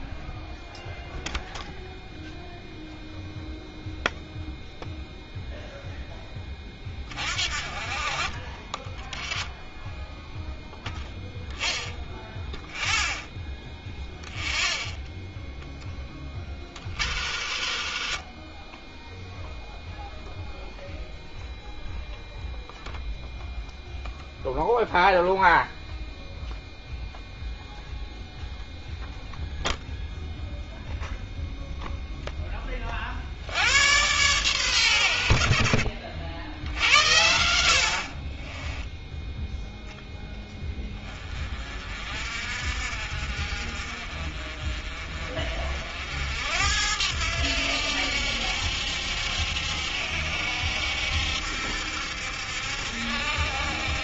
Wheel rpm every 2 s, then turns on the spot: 0, 0, 0, 20, 20, 0, 0, 0, 40, 30, 0, 0, 0, 0, 0, 0, 10, 110, 70, 20, 10, 50, 40, 80, 70, 70, 70.
16-20 38-40